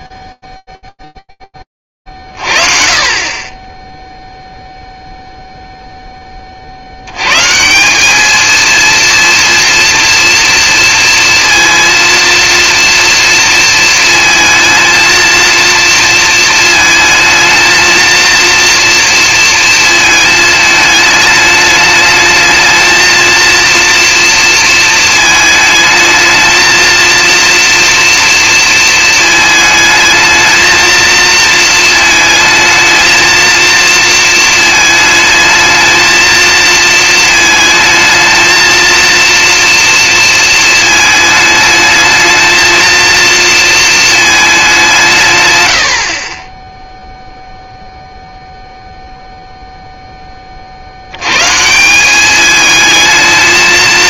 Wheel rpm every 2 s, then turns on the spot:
0, 40, 0, 80, 230, 230, 230, 230, 220, 230, 210, 220, 230, 230, 230, 220, 220, 220, 230, 230, 220, 220, 160, 0, 0, 120, 220.
none